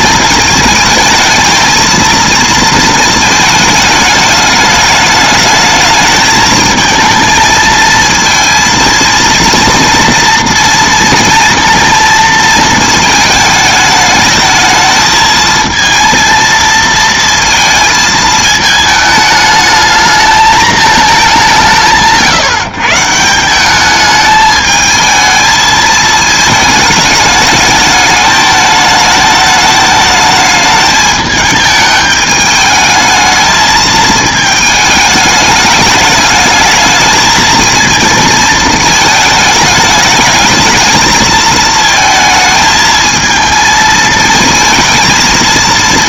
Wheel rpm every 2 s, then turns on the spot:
220, 230, 210, 220, 230, 230, 220, 220, 230, 220, 220, 150, 220, 220, 220, 210, 210, 220, 210, 220, 220, 220, 220.
none